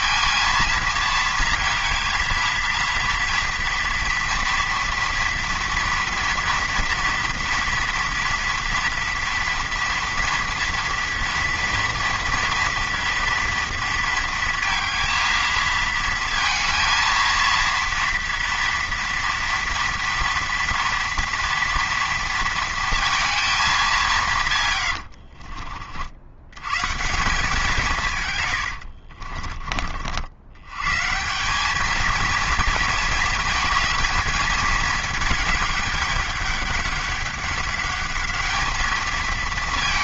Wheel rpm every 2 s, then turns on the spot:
230, 230, 230, 230, 230, 230, 230, 230, 230, 230, 230, 230, 120, 120, 90, 120, 230, 220, 200, 210.
24-26 28-30